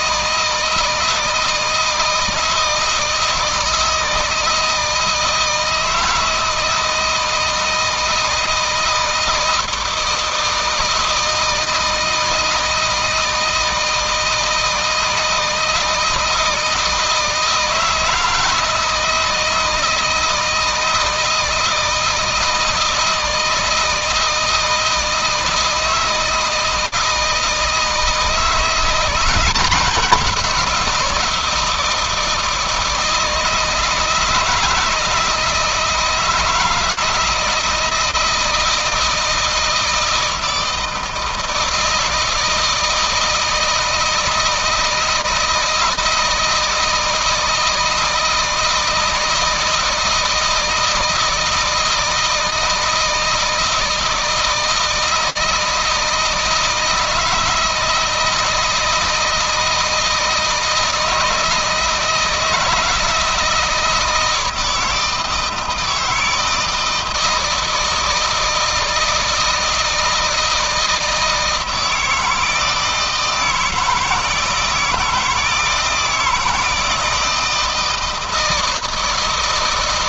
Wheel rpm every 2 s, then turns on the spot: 160, 170, 160, 160, 160, 160, 160, 160, 160, 160, 160, 160, 160, 160, 170, 180, 160, 160, 160, 160, 160, 160, 160, 160, 160, 160, 160, 160, 160, 170, 160, 160, 160, 160, 160, 160, 160, 160, 160, 160.
none